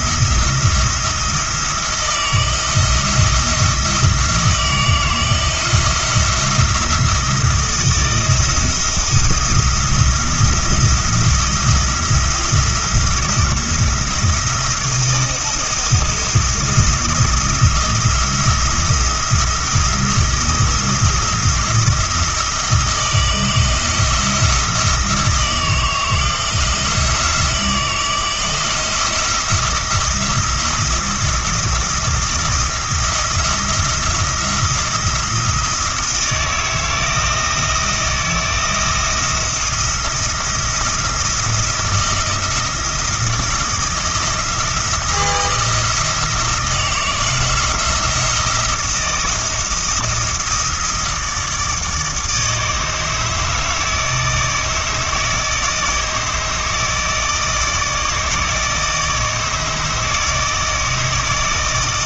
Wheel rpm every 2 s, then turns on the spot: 170, 170, 160, 170, 170, 170, 170, 170, 170, 170, 170, 160, 160, 170, 170, 170, 170, 170, 160, 160, 160, 160, 170, 160, 170, 160, 150, 160, 160, 160, 160.
none